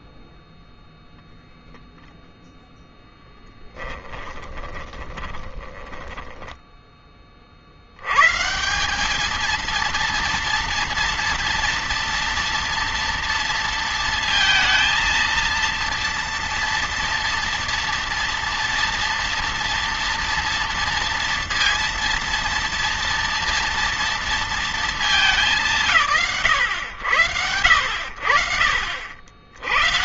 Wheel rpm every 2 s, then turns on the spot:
0, 10, 30, 10, 200, 230, 230, 230, 230, 230, 230, 240, 230, 100, 70.
4-6